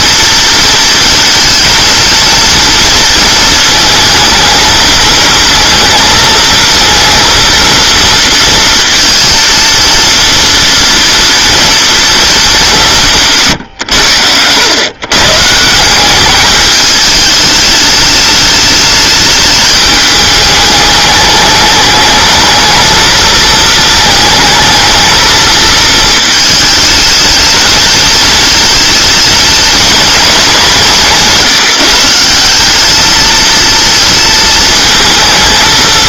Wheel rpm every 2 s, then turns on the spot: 230, 230, 220, 230, 230, 230, 180, 110, 210, 210, 210, 220, 220, 220, 220, 190, 200, 230.
none